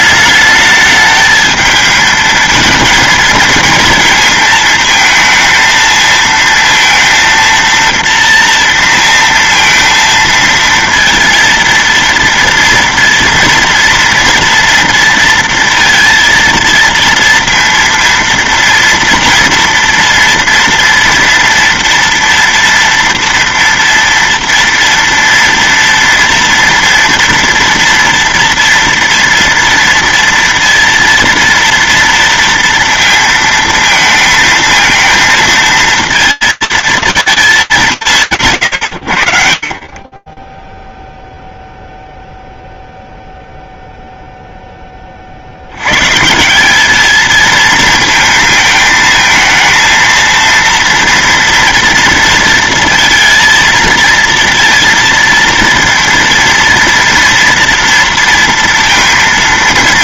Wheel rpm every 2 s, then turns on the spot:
210, 220, 230, 230, 230, 230, 230, 230, 230, 230, 230, 230, 230, 230, 230, 230, 230, 220, 230, 130, 10, 0, 30, 220, 220, 240, 230, 230, 230, 230.
none